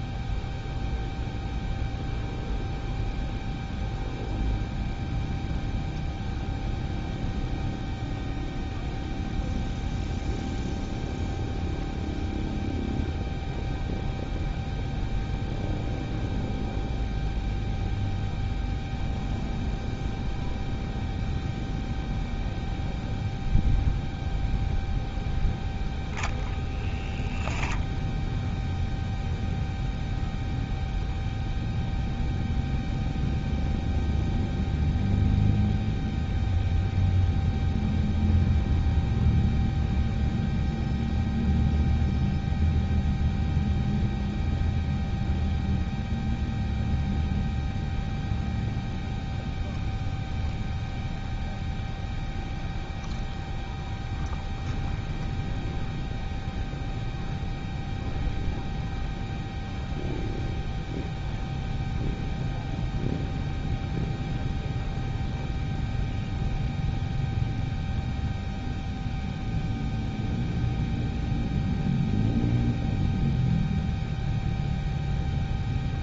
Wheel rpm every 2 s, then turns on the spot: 0, 0, 0, 0, 0, 0, 0, 0, 0, 0, 0, 0, 0, 0, 0, 0, 0, 0, 0, 0, 0, 0, 0, 0, 0, 0, 0, 0, 0, 0, 0, 0, 0, 0, 0, 0, 0, 0.
none